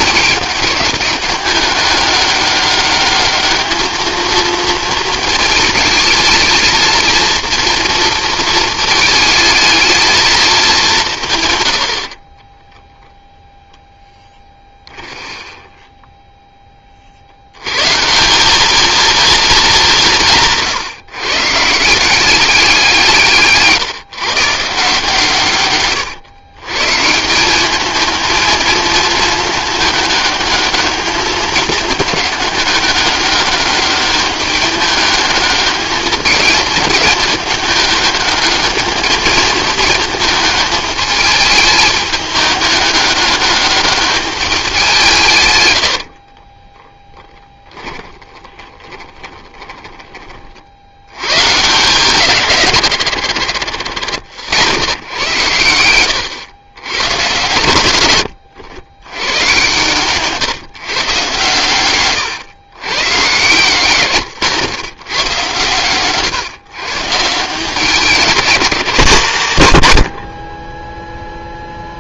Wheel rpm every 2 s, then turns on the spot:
200, 200, 230, 230, 230, 200, 10, 20, 20, 210, 150, 180, 150, 120, 220, 210, 210, 200, 220, 210, 220, 210, 190, 20, 20, 50, 140, 110, 110, 90, 140, 110, 120, 140, 190, 20.
12-16 46-50